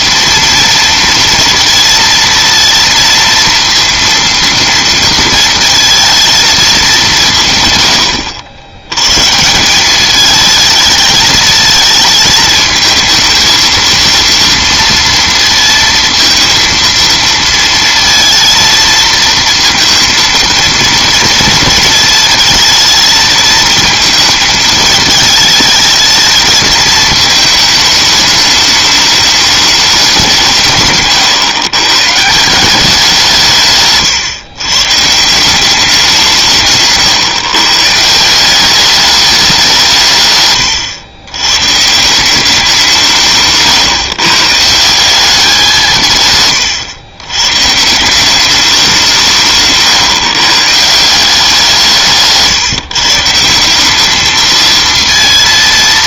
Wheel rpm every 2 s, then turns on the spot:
230, 230, 230, 210, 90, 220, 220, 230, 230, 230, 230, 220, 220, 220, 210, 150, 180, 130, 150, 200, 120, 180, 160, 130, 190, 150, 160, 230.
none